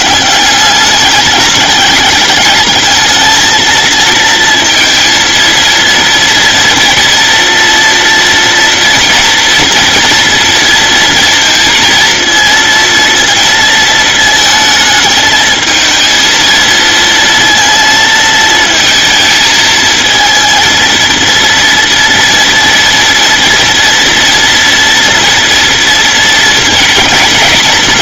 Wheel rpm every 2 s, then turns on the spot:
190, 210, 230, 230, 240, 230, 230, 220, 230, 230, 230, 230, 230, 230.
none